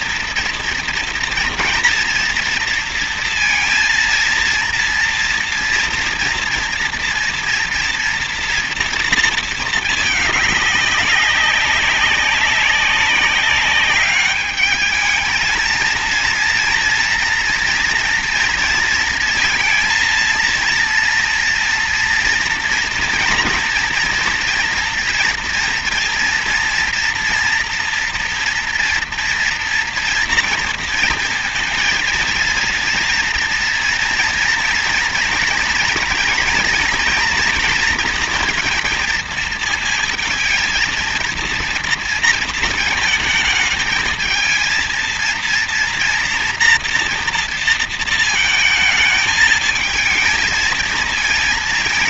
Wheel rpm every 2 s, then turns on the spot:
230, 230, 230, 230, 230, 200, 190, 210, 230, 230, 230, 230, 230, 230, 230, 230, 230, 230, 230, 230, 230, 230, 230, 230, 220, 220.
none